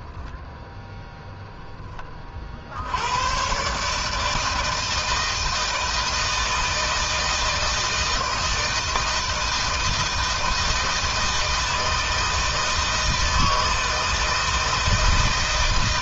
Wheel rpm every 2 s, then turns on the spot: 0, 80, 160, 160, 160, 160, 160, 160.
none